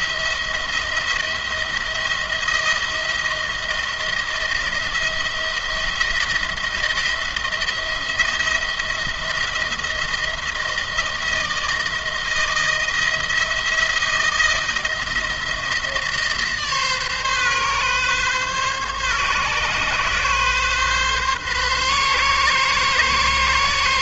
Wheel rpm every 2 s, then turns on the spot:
170, 170, 170, 170, 170, 160, 170, 170, 150, 140, 130, 130.
none